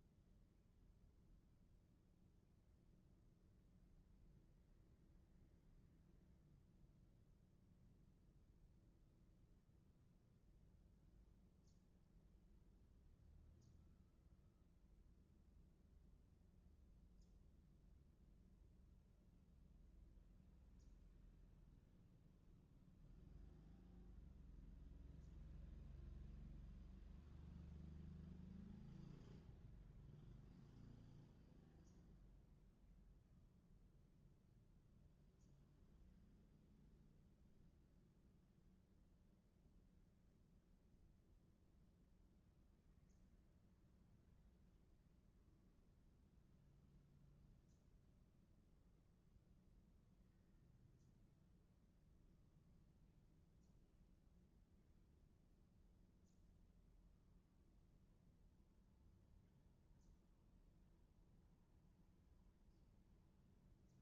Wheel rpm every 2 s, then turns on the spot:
0, 0, 0, 0, 0, 0, 0, 0, 0, 0, 0, 0, 0, 0, 0, 0, 0, 0, 0, 0, 0, 0, 0, 0, 0, 0, 0, 0, 0, 0, 0, 0.
none